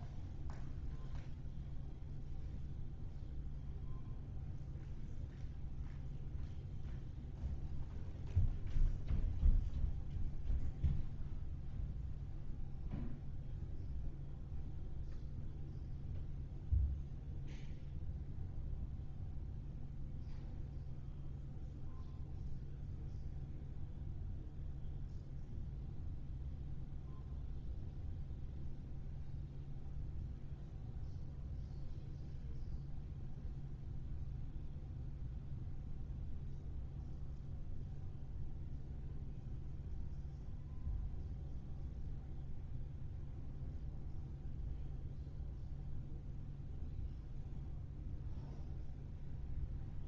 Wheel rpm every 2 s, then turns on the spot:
0, 0, 0, 0, 0, 0, 0, 0, 0, 0, 0, 0, 0, 0, 0, 0, 0, 0, 0, 0, 0, 0, 0, 0, 0.
none